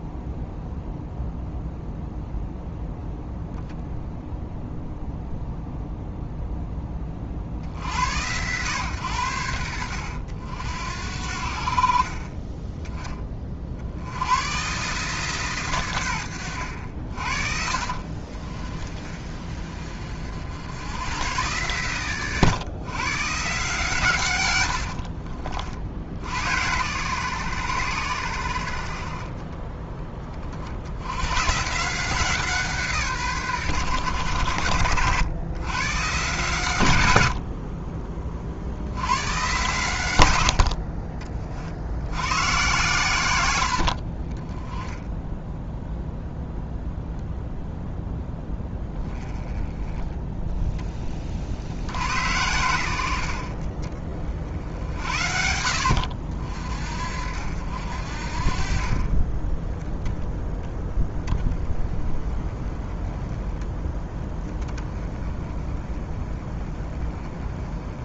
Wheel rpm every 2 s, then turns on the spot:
0, 0, 0, 20, 110, 70, 20, 140, 70, 30, 100, 130, 80, 110, 50, 80, 150, 80, 100, 70, 50, 120, 10, 0, 10, 20, 90, 60, 50, 40, 10, 20, 20, 20.
24-26